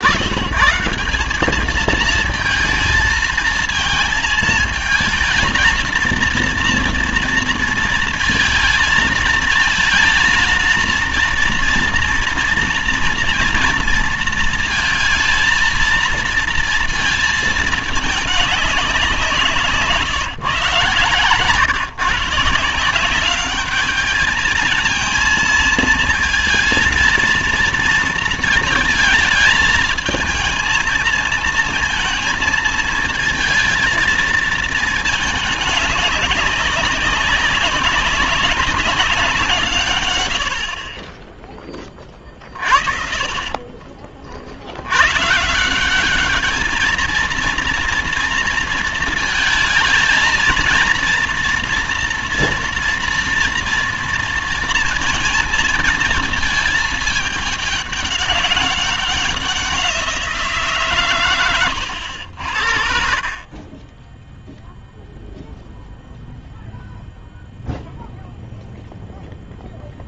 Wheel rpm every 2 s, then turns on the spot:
180, 230, 220, 230, 220, 230, 230, 230, 230, 190, 140, 180, 230, 230, 220, 230, 220, 220, 190, 190, 40, 40, 90, 220, 230, 230, 230, 230, 210, 200, 130, 50, 0, 0, 0.
20-22 42-44